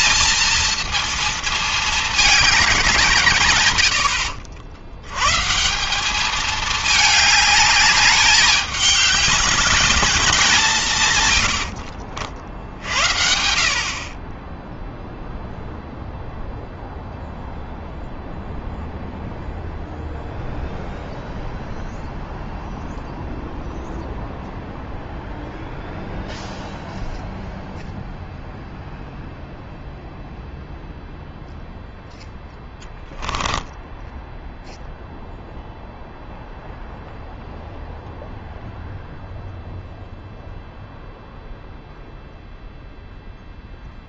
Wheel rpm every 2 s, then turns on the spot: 230, 200, 90, 210, 210, 180, 60, 20, 0, 0, 0, 0, 0, 0, 0, 0, 0, 0, 0, 0, 0, 0.
none